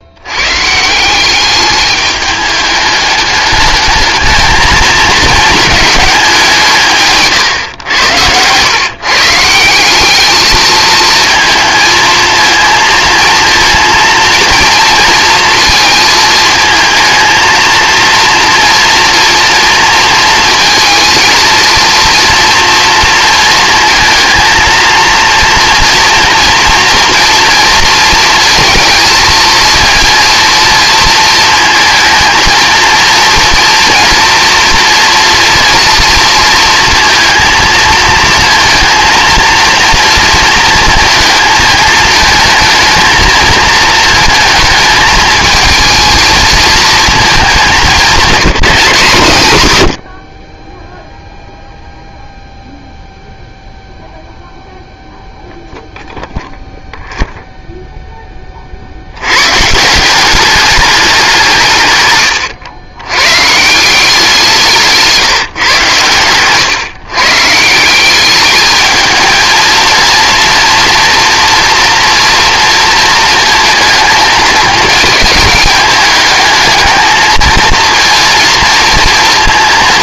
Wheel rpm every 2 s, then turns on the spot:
160, 210, 220, 150, 120, 220, 230, 230, 220, 230, 230, 230, 230, 230, 230, 230, 230, 230, 230, 230, 230, 220, 230, 230, 190, 10, 0, 0, 0, 60, 200, 120, 160, 130, 210, 230, 230, 220, 220, 230.
none